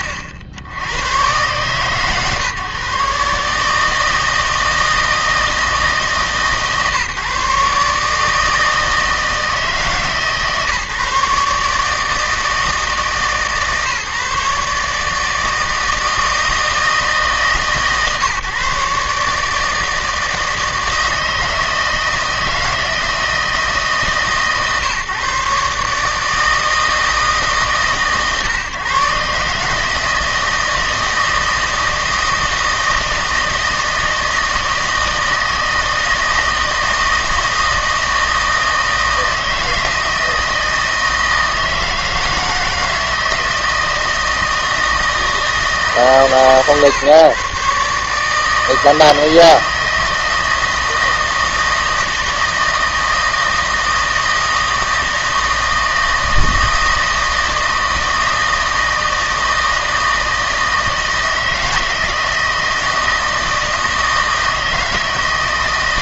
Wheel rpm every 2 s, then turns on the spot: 70, 140, 160, 140, 160, 150, 160, 150, 160, 140, 160, 160, 150, 160, 140, 160, 160, 160, 160, 160, 160, 160, 160, 130, 160, 160, 160, 160, 160, 160, 160, 160, 160.
none